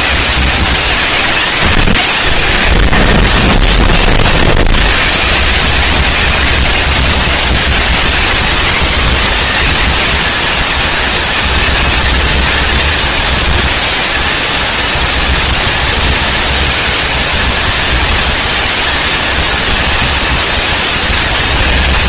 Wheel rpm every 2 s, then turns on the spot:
190, 90, 30, 190, 230, 240, 230, 230, 230, 220, 230.
none